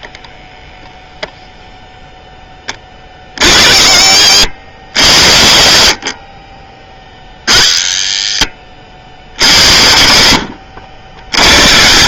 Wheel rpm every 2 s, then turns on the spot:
0, 20, 100, 30, 40, 60.
none